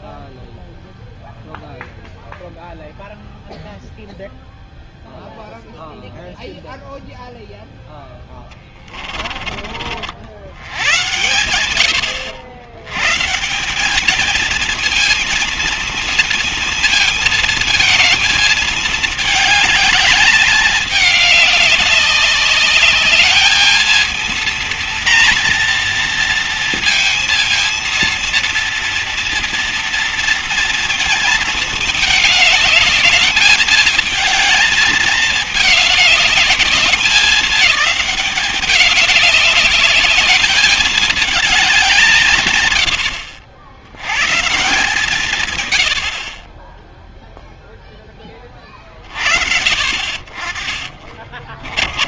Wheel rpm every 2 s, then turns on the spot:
0, 0, 0, 0, 20, 100, 110, 220, 230, 220, 210, 210, 230, 230, 230, 230, 210, 210, 200, 200, 210, 100, 150, 10, 30, 40.
8-10 50-52